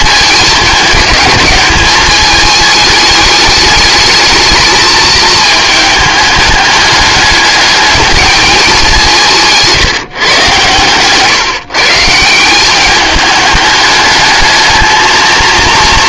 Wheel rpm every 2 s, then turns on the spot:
210, 220, 220, 210, 200, 130, 200, 220.
10-12